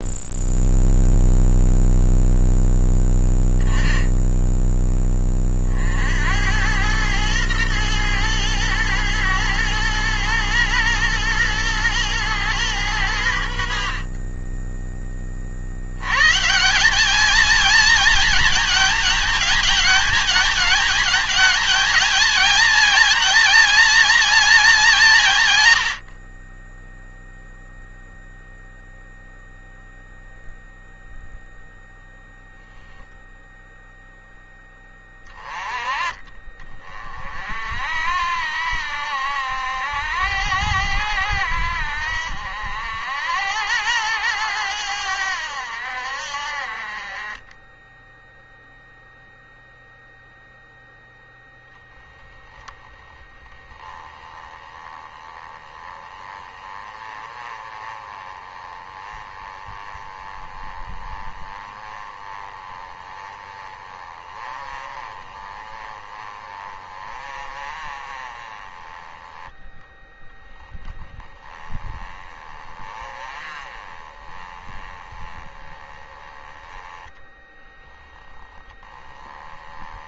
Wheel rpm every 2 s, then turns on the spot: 0, 0, 0, 80, 110, 120, 120, 30, 130, 220, 220, 220, 220, 40, 0, 0, 0, 10, 30, 60, 80, 70, 90, 60, 0, 0, 10, 10, 20, 20, 20, 20, 30, 30, 20, 20, 30, 20, 10, 10.
none